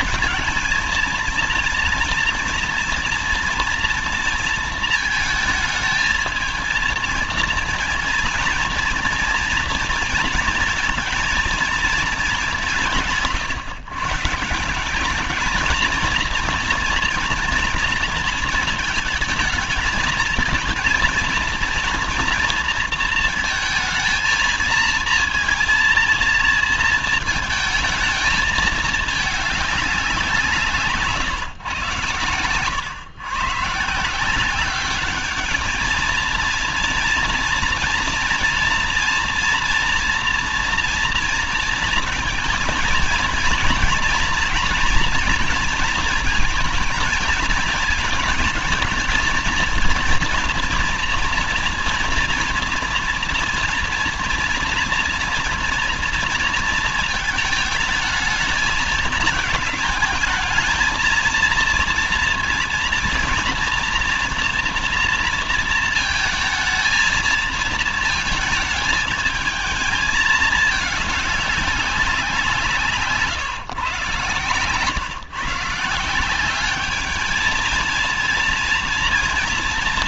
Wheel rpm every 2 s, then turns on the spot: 220, 230, 230, 220, 230, 230, 200, 170, 240, 230, 230, 230, 230, 230, 210, 170, 120, 180, 230, 230, 240, 220, 230, 230, 220, 230, 230, 230, 230, 220, 220, 230, 230, 220, 220, 220, 180, 140, 190, 230.
none